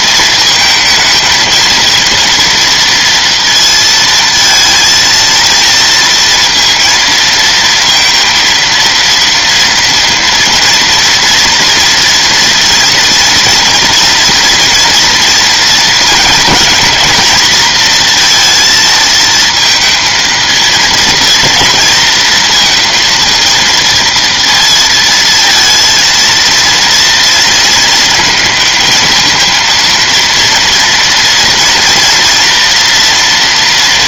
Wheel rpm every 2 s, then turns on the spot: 230, 240, 230, 230, 230, 230, 230, 230, 230, 230, 230, 230, 230, 230, 230, 230, 230.
none